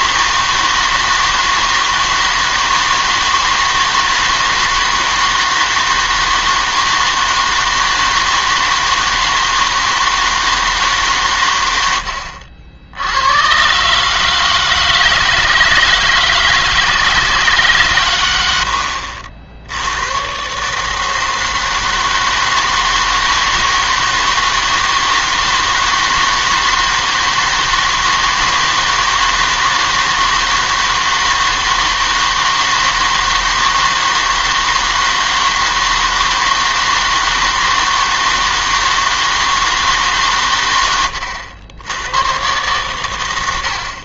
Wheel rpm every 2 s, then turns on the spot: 160, 160, 160, 160, 160, 150, 70, 160, 160, 80, 150, 160, 160, 160, 160, 160, 160, 160, 160, 160, 100, 110.
none